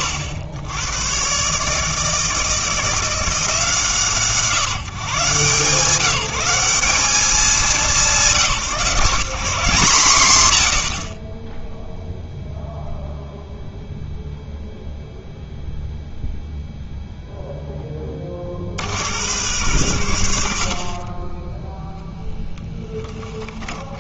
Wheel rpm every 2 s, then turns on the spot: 100, 160, 150, 190, 170, 110, 0, 0, 0, 60, 50, 20.
22-24